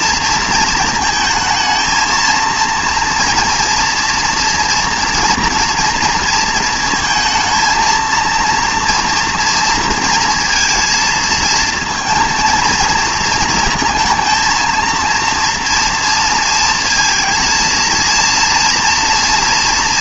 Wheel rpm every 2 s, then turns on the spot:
230, 230, 240, 230, 230, 230, 230, 220, 220, 230.
none